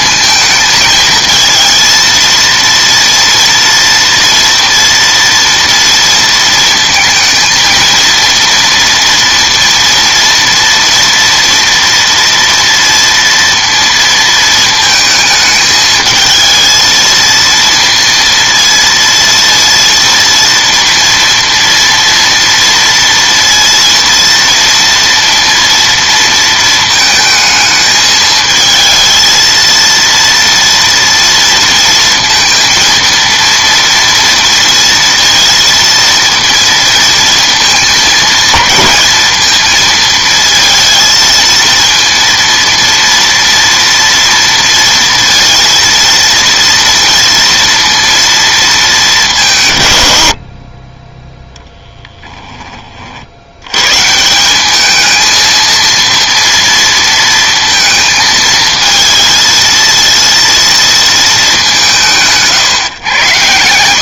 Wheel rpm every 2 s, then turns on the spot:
220, 230, 230, 230, 230, 230, 230, 220, 220, 230, 230, 230, 230, 230, 220, 230, 230, 230, 230, 220, 230, 230, 230, 230, 220, 50, 20, 190, 230, 220, 230, 150.
none